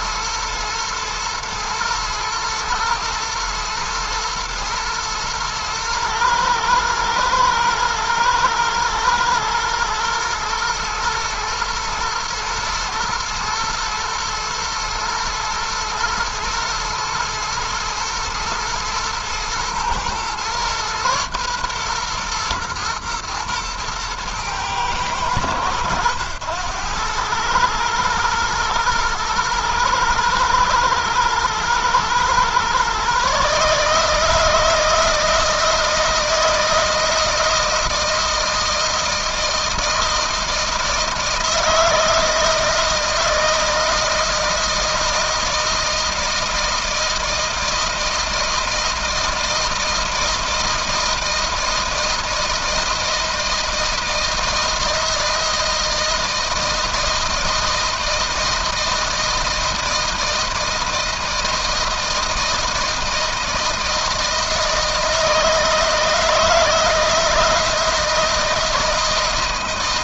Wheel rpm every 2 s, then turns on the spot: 110, 110, 120, 110, 110, 120, 120, 120, 120, 120, 120, 120, 110, 100, 110, 110, 120, 160, 160, 160, 160, 160, 160, 160, 160, 160, 160, 160, 160, 160, 160, 160, 160, 160, 160.
none